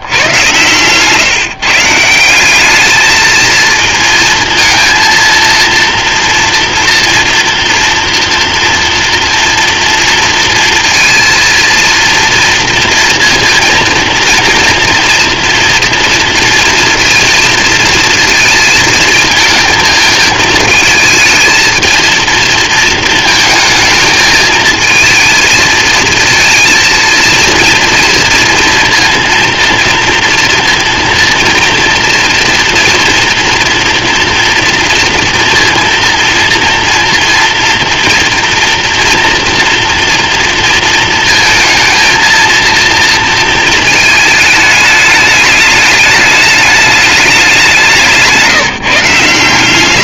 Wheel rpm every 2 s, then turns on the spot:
120, 200, 230, 230, 230, 230, 230, 230, 230, 220, 220, 220, 220, 230, 230, 230, 240, 230, 230, 240, 230, 230, 210, 210, 160.
0-2